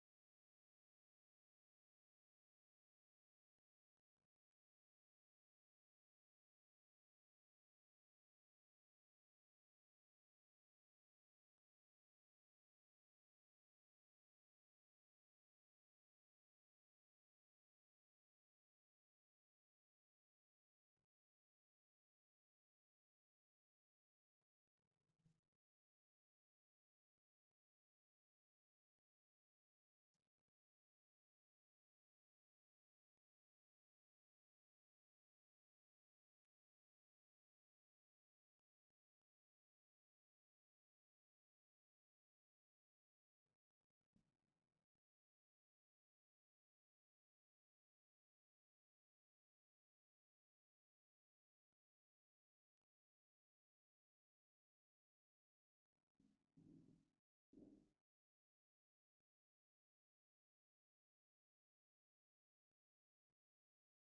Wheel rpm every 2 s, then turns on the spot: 0, 0, 0, 0, 0, 0, 0, 0, 0, 0, 0, 0, 0, 0, 0, 0, 0, 0, 0, 0, 0, 0, 0, 0, 0, 0, 0, 0, 0, 0, 0, 0.
none